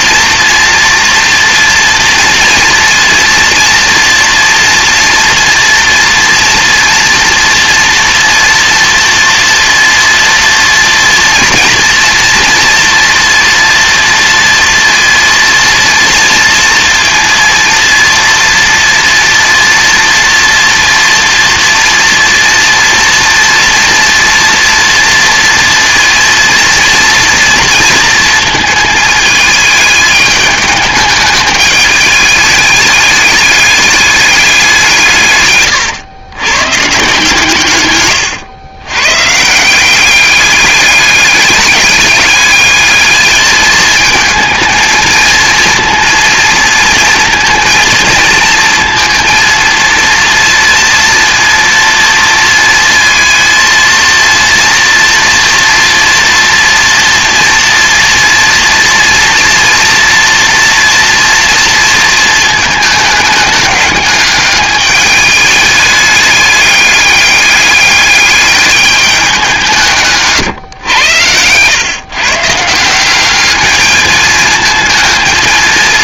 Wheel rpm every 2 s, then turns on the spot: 240, 230, 230, 240, 230, 230, 240, 230, 230, 230, 230, 230, 230, 230, 220, 210, 210, 190, 120, 110, 200, 210, 220, 230, 230, 230, 230, 230, 240, 230, 230, 220, 210, 210, 210, 120, 160, 220.
none